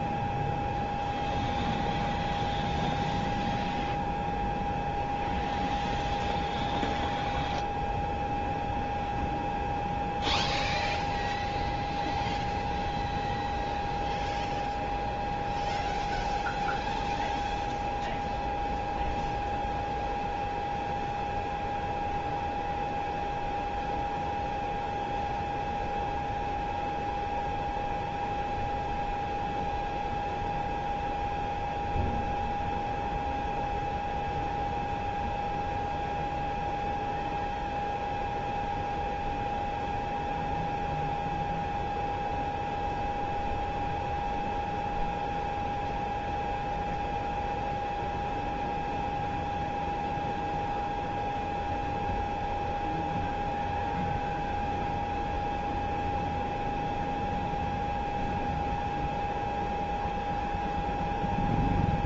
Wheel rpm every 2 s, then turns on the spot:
0, 0, 0, 0, 0, 0, 0, 0, 0, 0, 0, 0, 0, 0, 0, 0, 0, 0, 0, 0, 0, 0, 0, 0, 0, 0, 0, 0, 0, 0, 0.
none